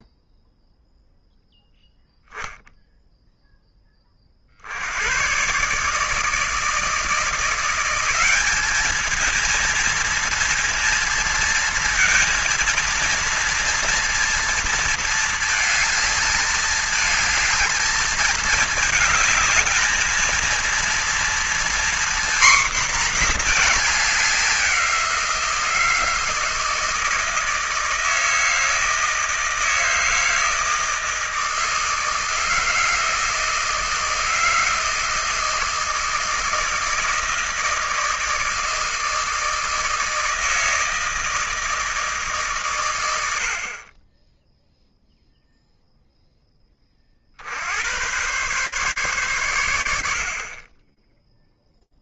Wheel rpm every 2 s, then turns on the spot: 0, 0, 60, 160, 210, 230, 230, 230, 220, 220, 230, 250, 190, 160, 160, 160, 160, 160, 160, 160, 160, 140, 10, 20, 130, 30.
none